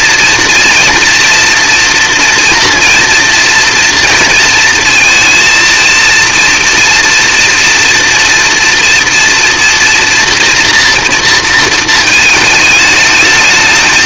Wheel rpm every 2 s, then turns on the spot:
230, 230, 230, 230, 230, 240, 220.
none